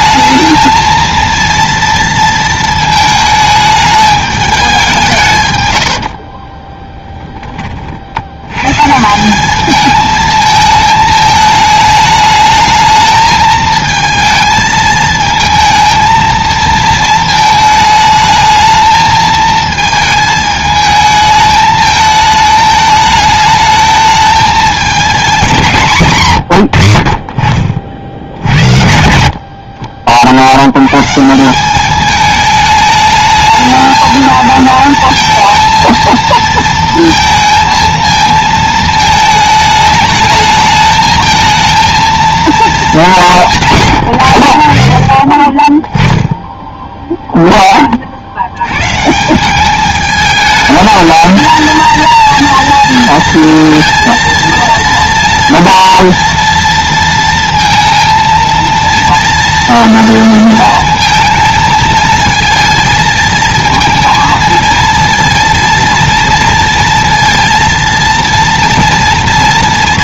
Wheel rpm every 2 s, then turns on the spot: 220, 220, 190, 20, 130, 220, 220, 220, 230, 220, 220, 220, 220, 100, 90, 110, 210, 220, 230, 220, 220, 220, 70, 0, 120, 220, 230, 230, 230, 230, 230, 230, 230, 230, 230.
6-8